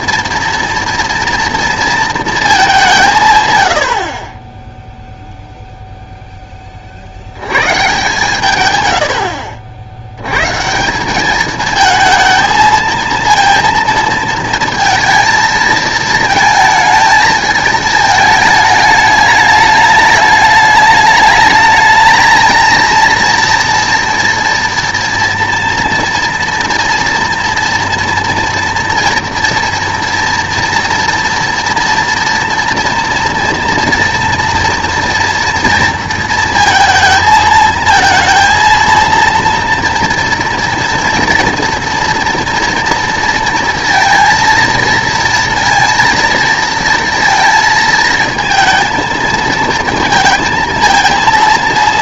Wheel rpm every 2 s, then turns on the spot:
230, 210, 10, 20, 120, 140, 230, 230, 220, 210, 210, 220, 230, 230, 230, 230, 230, 230, 230, 230, 240, 240, 230, 230, 220, 230.
4-6